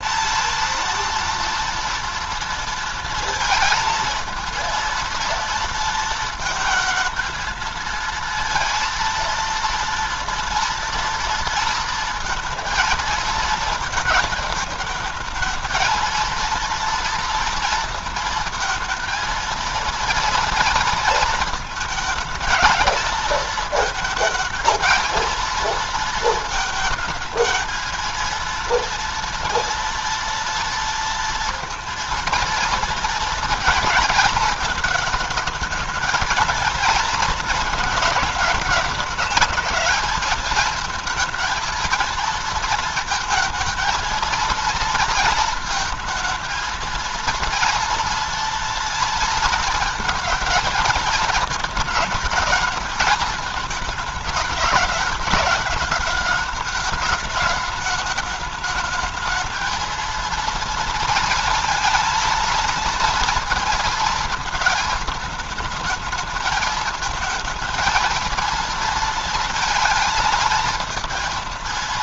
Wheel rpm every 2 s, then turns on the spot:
230, 230, 230, 220, 230, 230, 230, 220, 230, 220, 230, 220, 220, 220, 230, 230, 230, 220, 220, 210, 220, 230, 230, 230, 230, 220, 210, 220, 210, 210, 230, 230, 220, 220, 230, 230.
none